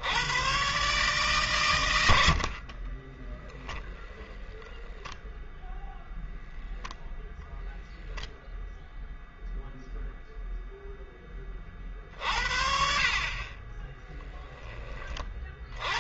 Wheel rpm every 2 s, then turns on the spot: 130, 40, 10, 0, 0, 0, 50, 10.
none